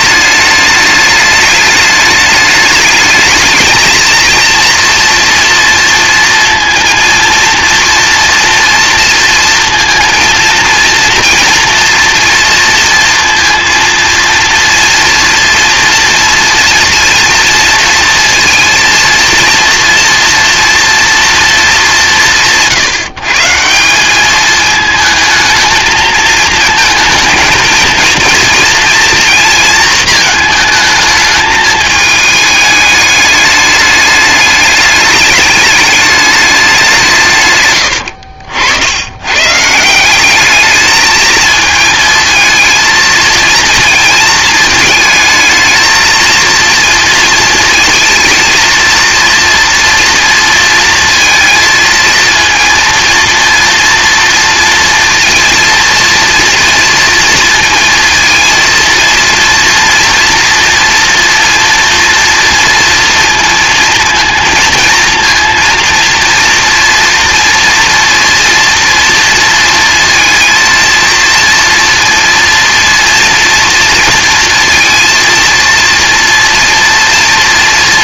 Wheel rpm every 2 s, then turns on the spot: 210, 210, 230, 230, 230, 230, 230, 230, 230, 230, 230, 160, 220, 230, 230, 220, 210, 210, 200, 70, 210, 220, 220, 230, 230, 230, 230, 230, 230, 230, 240, 230, 230, 230, 230, 230, 230, 230, 230.
none